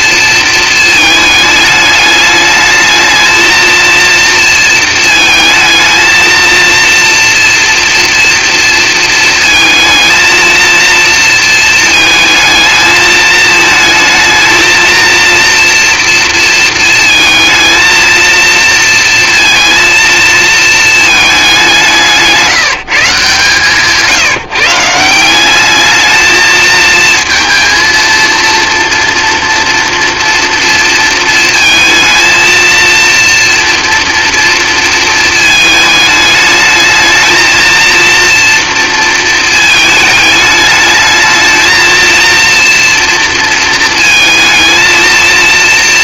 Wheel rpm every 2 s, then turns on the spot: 220, 220, 230, 220, 230, 220, 220, 220, 220, 230, 230, 170, 150, 220, 230, 240, 230, 230, 220, 230, 210, 230, 220.
none